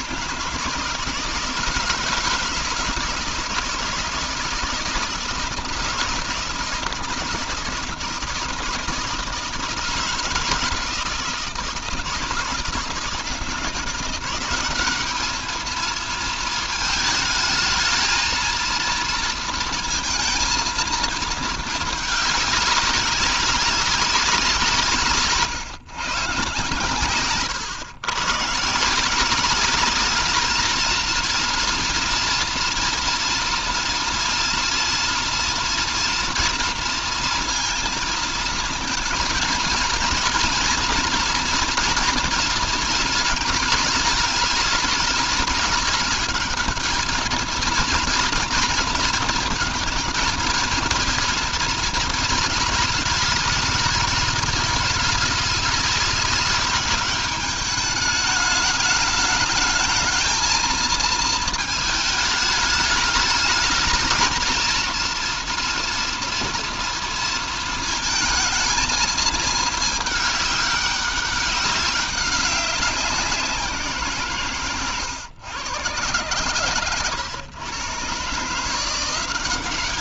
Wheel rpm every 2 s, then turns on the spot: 160, 160, 160, 160, 160, 160, 160, 210, 220, 230, 220, 200, 150, 130, 170, 230, 230, 230, 230, 230, 240, 230, 220, 220, 230, 230, 220, 210, 200, 210, 220, 210, 230, 230, 220, 200, 180, 120, 120, 180.
none